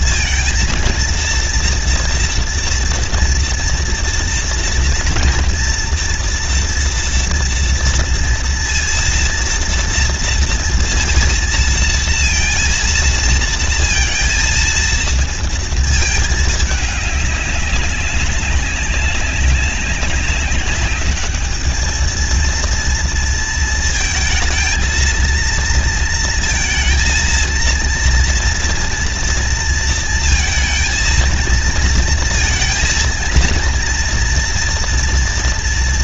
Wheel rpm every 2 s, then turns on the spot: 230, 230, 230, 230, 230, 230, 230, 230, 210, 190, 200, 230, 220, 230, 230, 230, 230, 230.
none